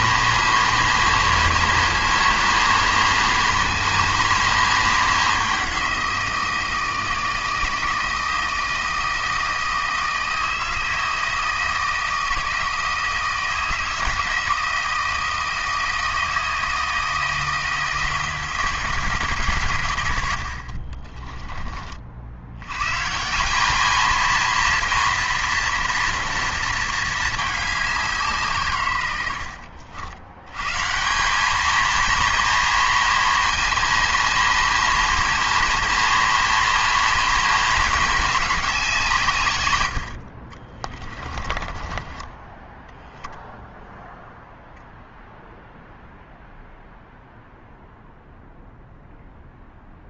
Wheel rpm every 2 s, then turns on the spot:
230, 230, 230, 170, 160, 160, 160, 160, 160, 160, 40, 110, 230, 230, 130, 140, 230, 230, 230, 190, 40, 10, 0, 0, 0.
20-22 40-42